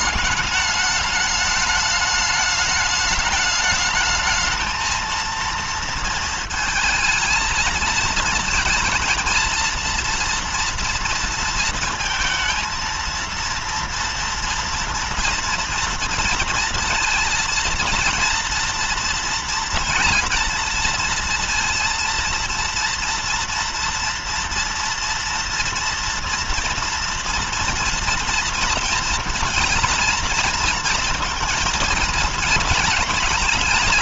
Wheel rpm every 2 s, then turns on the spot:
210, 210, 220, 230, 220, 230, 230, 230, 230, 230, 230, 230, 230, 230, 230, 230, 230.
none